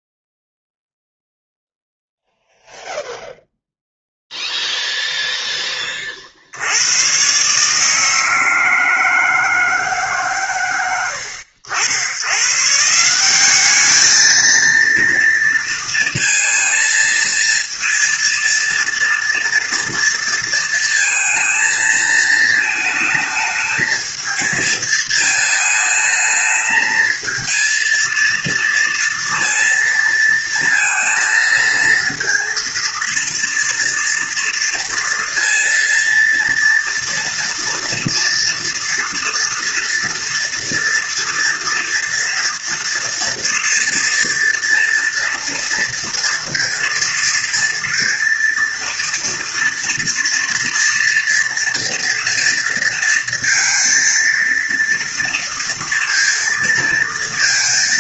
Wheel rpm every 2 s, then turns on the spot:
0, 0, 0, 60, 160, 130, 120, 220, 230, 230, 230, 220, 220, 220, 230, 220, 230, 230, 230, 240, 230, 230, 230, 230, 240, 230, 230, 230, 230.
none